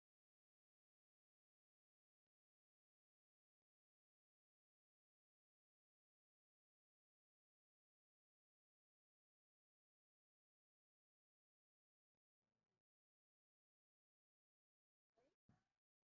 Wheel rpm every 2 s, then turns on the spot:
0, 0, 0, 0, 0, 0, 0, 0.
none